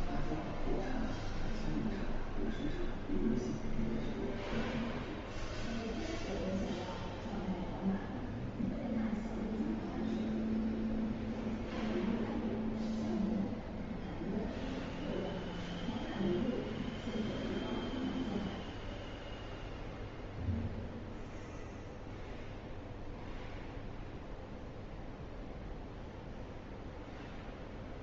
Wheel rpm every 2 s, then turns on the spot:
0, 0, 0, 0, 0, 0, 0, 0, 0, 0, 0, 0, 0, 0.
none